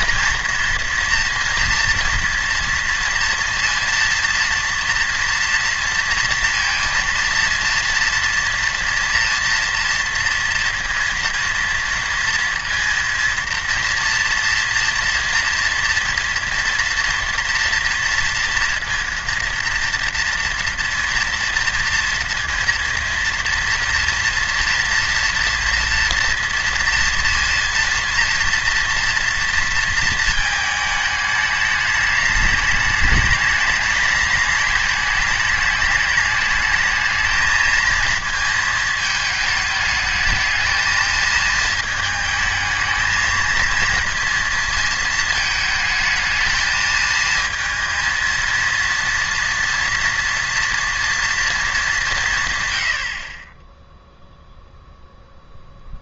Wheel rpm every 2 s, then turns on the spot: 230, 230, 240, 230, 230, 230, 230, 230, 230, 240, 230, 230, 230, 230, 230, 220, 210, 210, 210, 230, 220, 220, 230, 220, 230, 230, 140, 0.
none